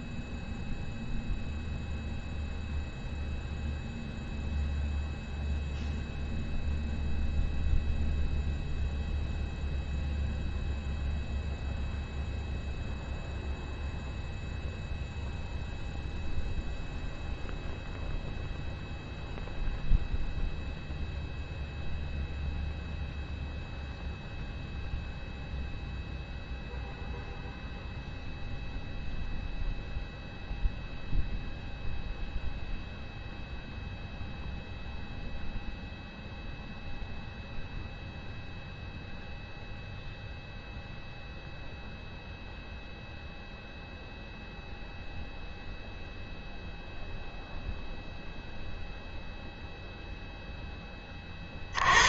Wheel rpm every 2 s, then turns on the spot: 0, 0, 0, 0, 0, 0, 0, 0, 0, 0, 0, 0, 0, 0, 0, 0, 0, 0, 0, 0, 0, 0, 0, 0, 0, 10.
none